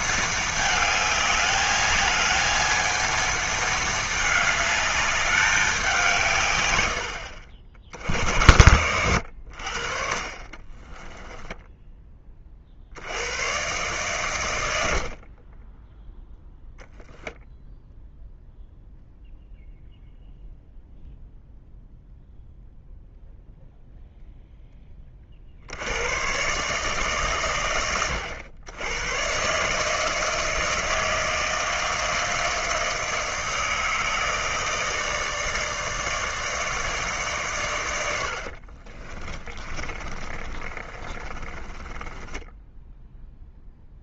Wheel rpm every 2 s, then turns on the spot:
220, 220, 210, 110, 90, 20, 50, 90, 0, 0, 0, 0, 10, 140, 90, 160, 160, 160, 160, 50, 30, 0.
10-12 38-42